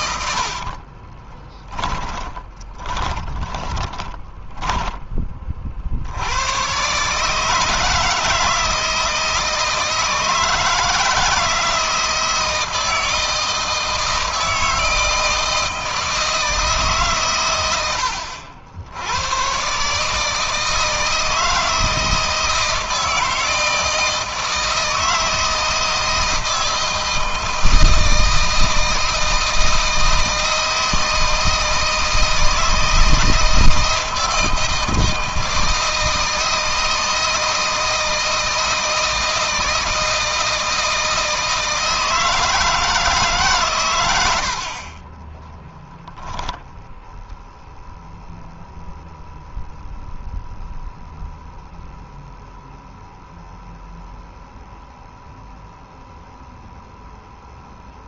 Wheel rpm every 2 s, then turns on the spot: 40, 20, 20, 120, 160, 160, 160, 160, 150, 80, 160, 160, 160, 160, 160, 160, 160, 160, 160, 160, 160, 160, 40, 0, 0, 0, 0, 0, 0.
0-6